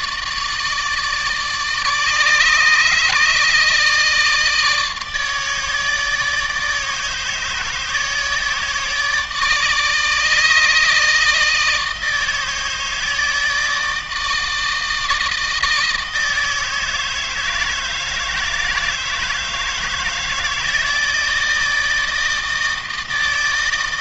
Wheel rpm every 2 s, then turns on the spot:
160, 150, 160, 160, 150, 160, 160, 160, 160, 160, 160, 160.
none